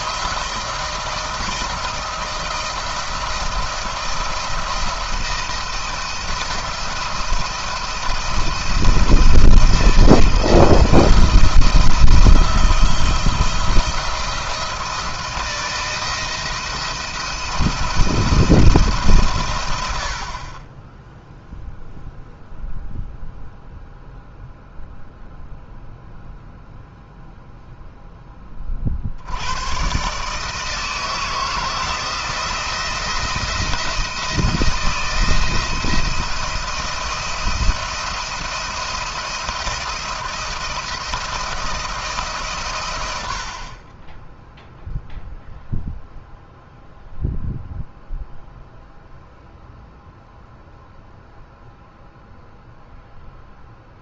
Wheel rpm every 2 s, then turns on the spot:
160, 160, 170, 170, 170, 170, 170, 160, 170, 170, 40, 0, 0, 0, 30, 150, 170, 160, 170, 170, 170, 150, 10, 0, 0, 0, 0.
none